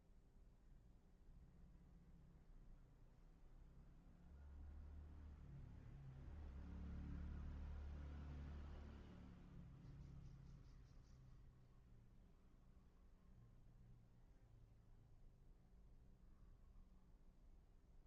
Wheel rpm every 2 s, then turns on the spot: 0, 0, 0, 0, 0, 0, 0, 0, 0.
none